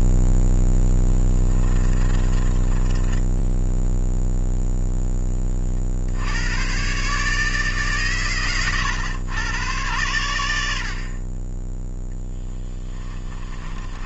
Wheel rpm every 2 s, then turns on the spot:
10, 20, 0, 130, 110, 80, 20.
0-4 12-14